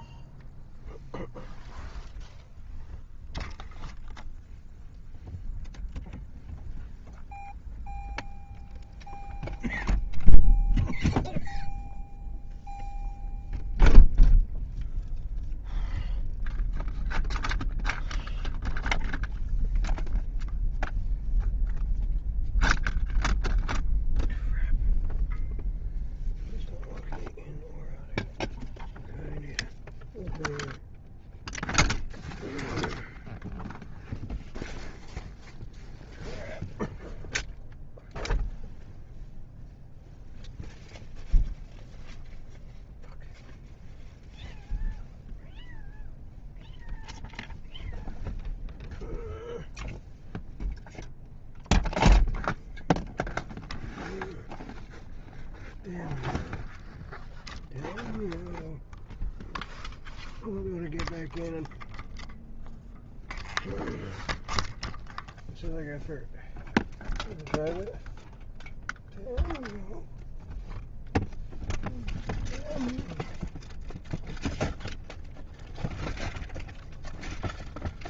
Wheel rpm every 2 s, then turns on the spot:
0, 0, 0, 0, 0, 0, 0, 0, 0, 0, 0, 0, 0, 0, 0, 0, 0, 0, 0, 0, 0, 0, 0, 0, 0, 0, 0, 0, 0, 0, 0, 0, 0, 0, 0, 0, 0, 0, 0.
none